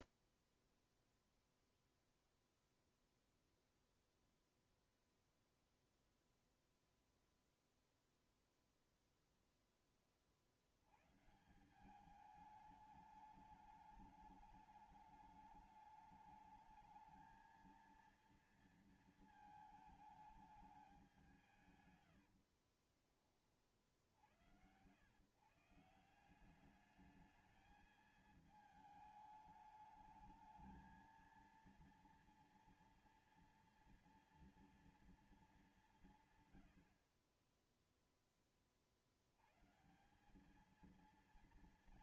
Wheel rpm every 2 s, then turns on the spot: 0, 0, 0, 0, 0, 40, 200, 210, 210, 230, 220, 80, 70, 170, 220, 220, 230, 230, 130, 20, 200.
22-24